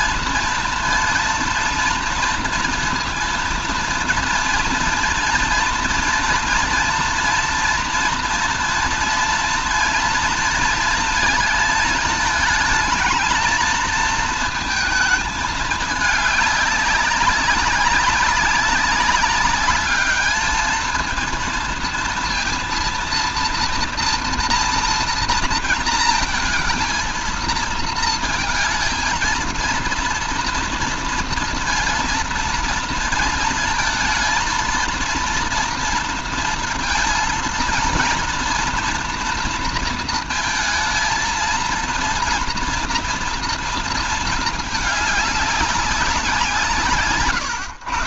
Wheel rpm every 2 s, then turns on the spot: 230, 230, 230, 230, 230, 230, 220, 220, 200, 200, 220, 230, 240, 220, 230, 240, 230, 230, 230, 230, 220, 230, 220, 160.
none